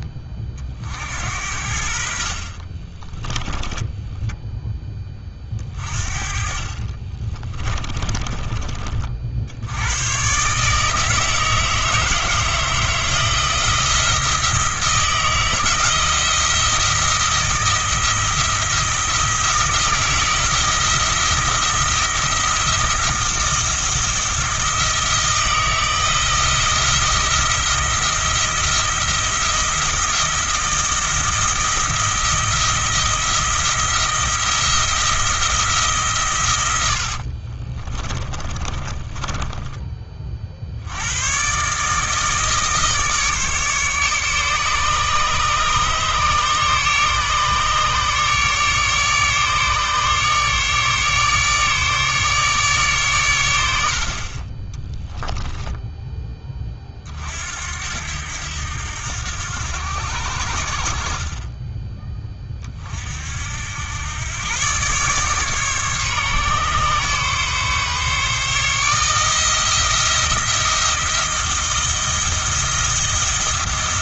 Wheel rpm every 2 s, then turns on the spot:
50, 20, 10, 40, 40, 150, 160, 160, 170, 160, 170, 170, 160, 170, 170, 170, 170, 170, 80, 30, 80, 150, 150, 150, 150, 150, 140, 10, 40, 90, 50, 40, 130, 140, 160, 170, 170.
2-4 6-8 36-40 54-56